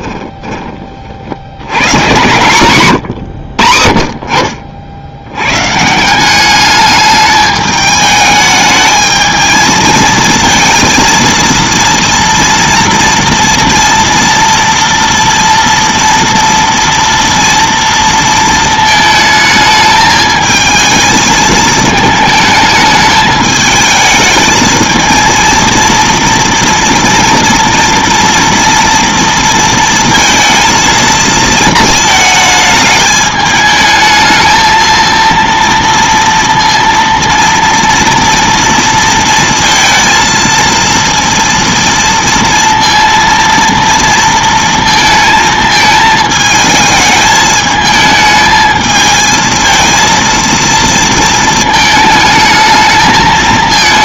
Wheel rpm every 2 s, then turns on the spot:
20, 130, 70, 210, 220, 230, 230, 230, 230, 220, 220, 220, 220, 230, 230, 230, 220, 220, 230, 230, 230, 230, 230, 220, 220, 230, 220.
2-4